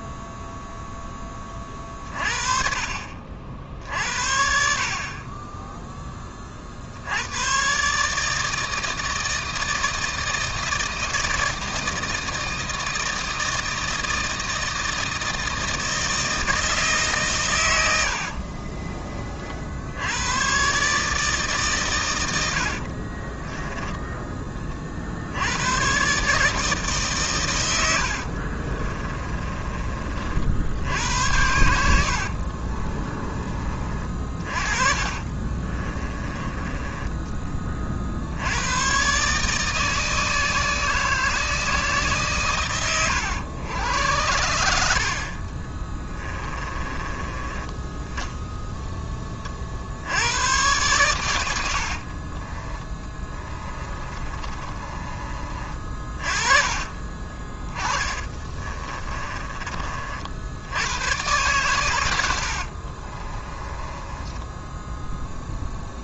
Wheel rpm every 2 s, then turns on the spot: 0, 40, 50, 50, 160, 160, 160, 160, 160, 30, 130, 80, 30, 150, 30, 60, 40, 40, 20, 110, 160, 130, 80, 20, 10, 110, 20, 30, 40, 30, 90, 50, 10.
18-20 22-24 28-30 32-38 46-48 52-60 62-66